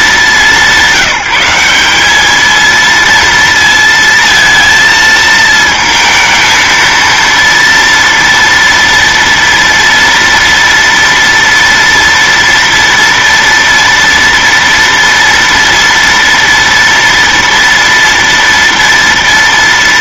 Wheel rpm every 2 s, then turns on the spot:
190, 230, 230, 230, 230, 240, 230, 240, 230, 230.
none